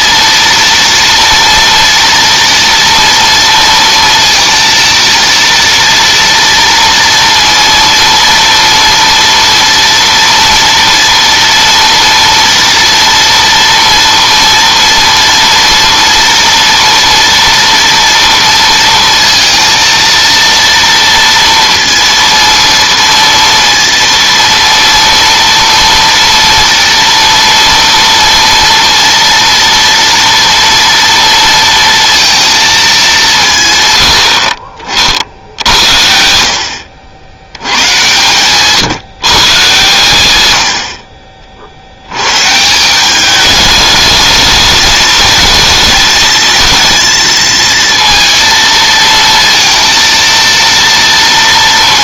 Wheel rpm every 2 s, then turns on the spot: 230, 240, 230, 230, 230, 230, 230, 230, 240, 230, 230, 230, 230, 230, 230, 230, 210, 50, 70, 140, 80, 170, 220, 230, 220, 230.
none